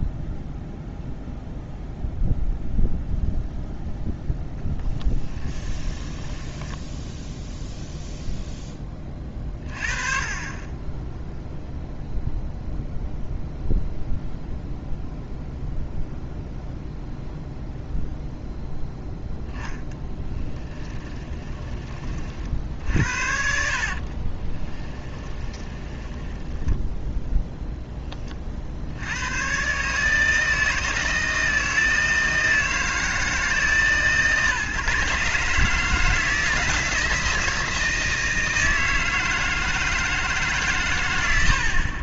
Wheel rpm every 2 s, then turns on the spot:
0, 0, 10, 10, 0, 20, 0, 0, 0, 0, 10, 50, 20, 10, 50, 160, 160, 150, 160, 160, 140.
6-8 20-26